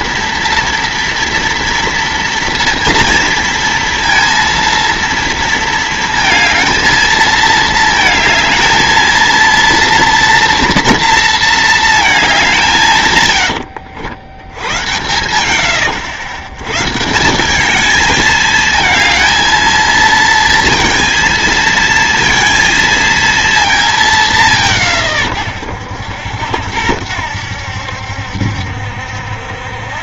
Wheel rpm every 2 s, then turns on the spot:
230, 230, 230, 220, 220, 230, 160, 90, 120, 220, 230, 230, 180, 80, 70.
none